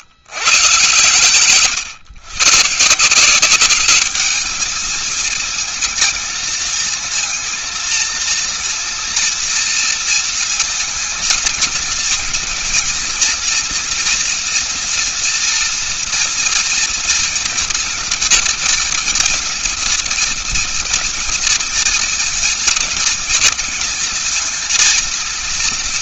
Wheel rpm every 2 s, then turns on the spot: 110, 130, 210, 230, 230, 230, 230, 240, 240, 240, 240, 230, 230.
none